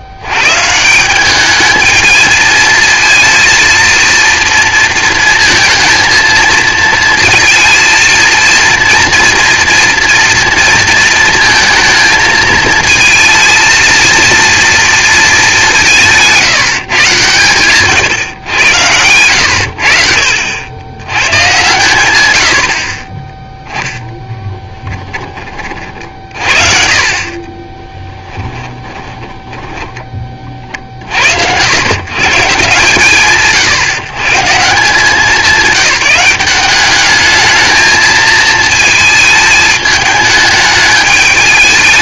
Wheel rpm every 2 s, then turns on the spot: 110, 220, 230, 220, 230, 230, 220, 230, 160, 100, 70, 100, 10, 50, 10, 20, 110, 130, 190, 220, 210.
24-26 28-30